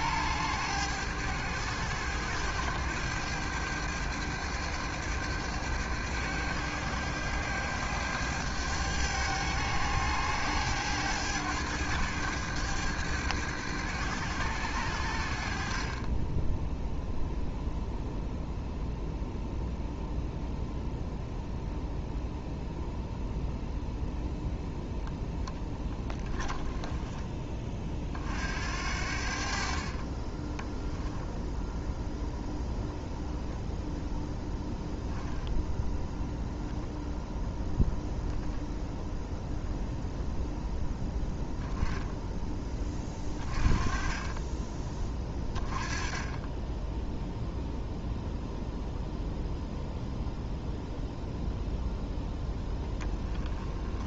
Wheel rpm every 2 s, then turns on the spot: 100, 100, 100, 100, 100, 100, 100, 80, 0, 0, 0, 0, 0, 10, 60, 10, 0, 0, 0, 0, 0, 20, 20, 0, 0, 0, 20.
42-44 52-54